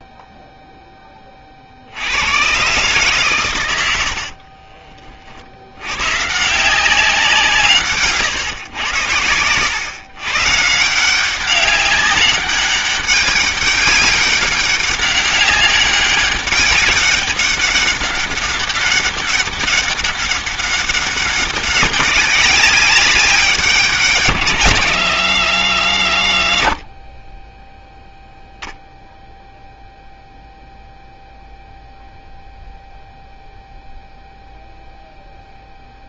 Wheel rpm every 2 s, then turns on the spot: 0, 130, 30, 180, 130, 140, 200, 200, 200, 200, 200, 190, 130, 40, 0, 0, 0, 0.
4-6